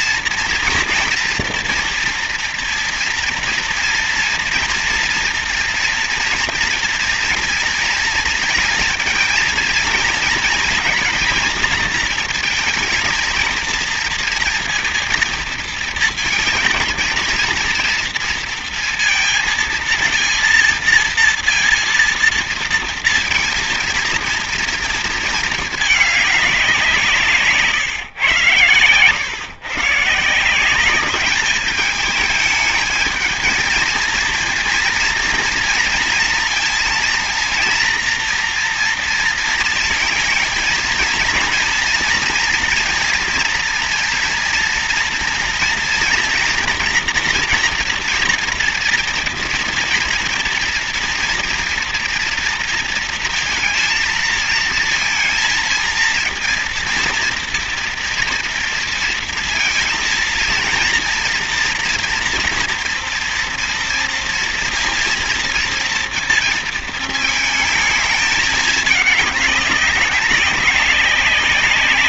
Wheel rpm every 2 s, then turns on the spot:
230, 230, 230, 230, 230, 240, 220, 230, 230, 230, 230, 230, 230, 180, 120, 190, 220, 230, 230, 230, 230, 230, 230, 240, 230, 230, 230, 230, 230, 230, 230, 230, 230, 230, 220, 200.
none